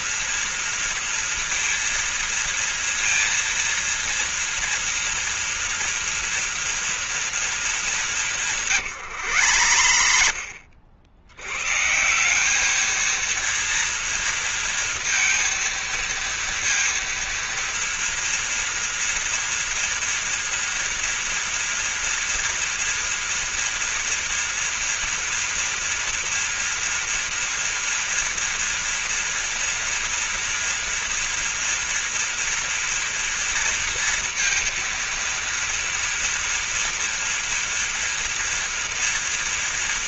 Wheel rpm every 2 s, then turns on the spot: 230, 230, 240, 230, 170, 60, 210, 230, 230, 230, 230, 230, 240, 230, 230, 230, 230, 230, 230, 230.
8-12